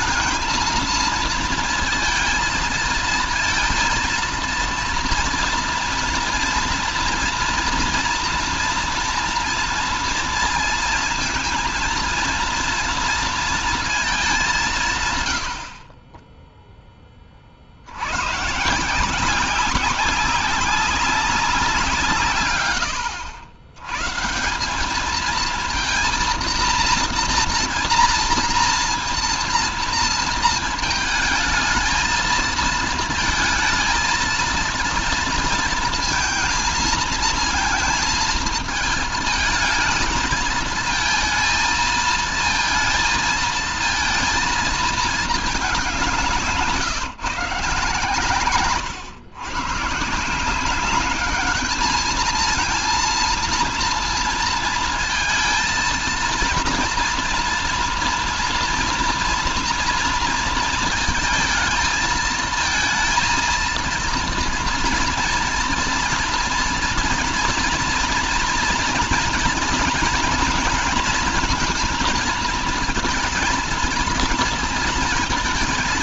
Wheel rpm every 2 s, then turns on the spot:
220, 220, 230, 230, 230, 230, 230, 180, 10, 140, 200, 120, 170, 230, 240, 230, 230, 230, 230, 220, 220, 230, 230, 140, 120, 180, 230, 230, 230, 240, 230, 220, 240, 240, 240, 230, 230, 220.
none